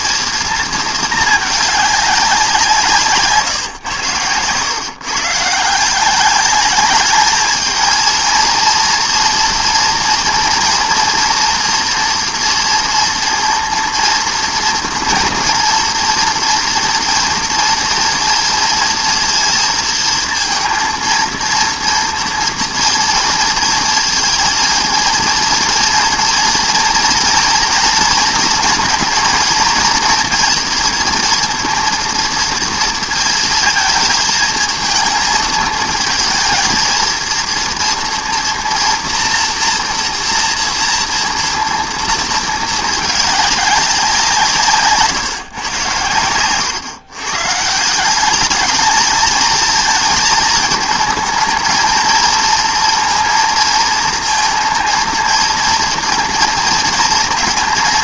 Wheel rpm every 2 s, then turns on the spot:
230, 180, 110, 200, 230, 230, 230, 230, 230, 230, 220, 230, 230, 230, 230, 230, 230, 220, 220, 230, 230, 230, 170, 110, 190, 220, 220, 230, 230.
none